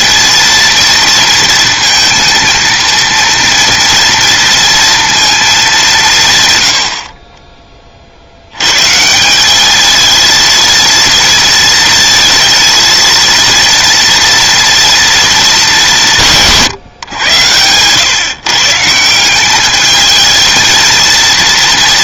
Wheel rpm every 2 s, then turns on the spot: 230, 230, 230, 90, 140, 230, 230, 230, 130, 160, 230.
16-18